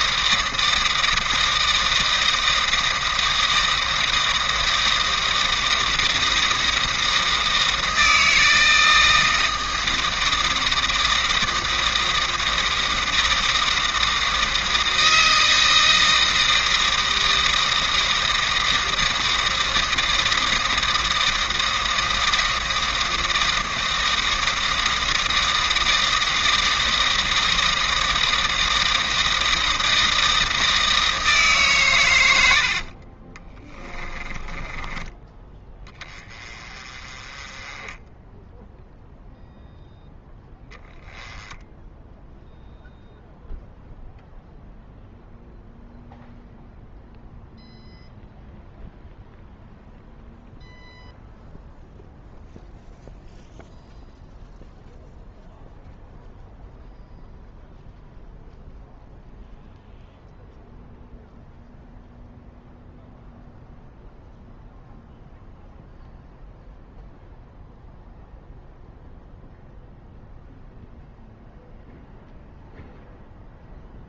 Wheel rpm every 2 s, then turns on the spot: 160, 160, 160, 160, 160, 160, 160, 160, 160, 160, 160, 160, 160, 160, 160, 160, 60, 20, 30, 0, 10, 0, 0, 0, 0, 0, 0, 0, 0, 0, 0, 0, 0, 0, 0, 0, 0.
32-34